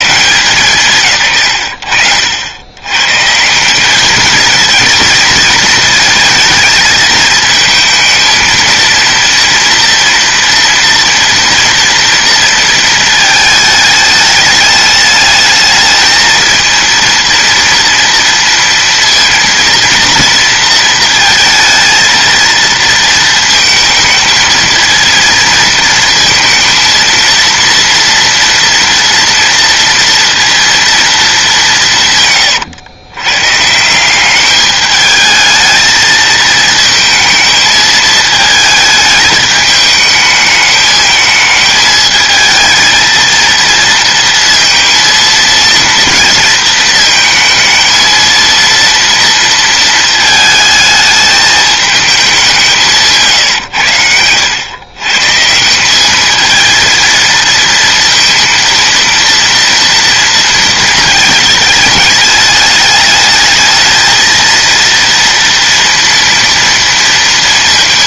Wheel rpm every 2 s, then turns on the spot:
160, 90, 220, 220, 230, 230, 230, 210, 220, 230, 230, 230, 220, 230, 230, 230, 110, 210, 220, 220, 220, 220, 230, 230, 230, 220, 190, 110, 230, 230, 230, 210, 230, 230.
none